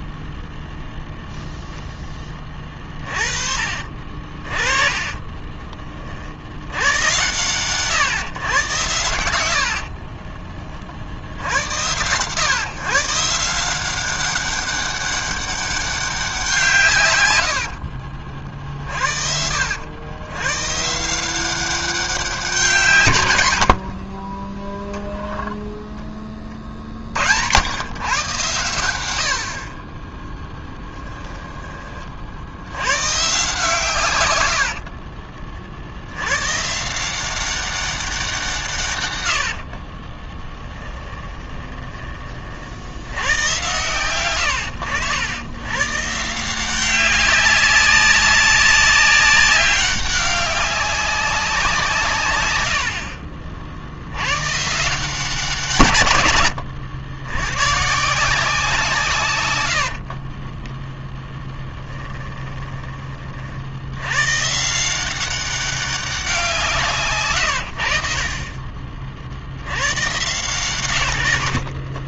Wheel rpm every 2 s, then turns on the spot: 0, 30, 20, 100, 100, 40, 140, 200, 130, 50, 140, 160, 10, 50, 90, 10, 100, 70, 150, 140, 20, 80, 100, 180, 190, 200, 90, 150, 110, 170, 10, 20, 170, 150, 40, 120.
2-4 30-32 34-36 40-42 60-62